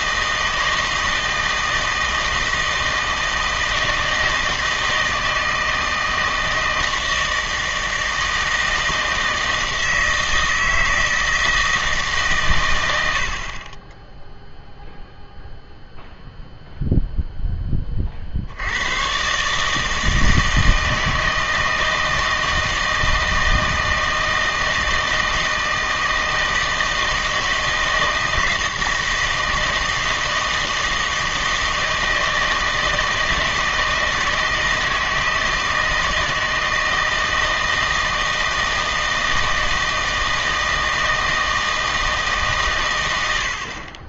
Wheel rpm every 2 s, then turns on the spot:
160, 160, 160, 160, 160, 160, 120, 0, 0, 80, 160, 160, 160, 160, 160, 160, 160, 160, 160, 160, 160, 130.
none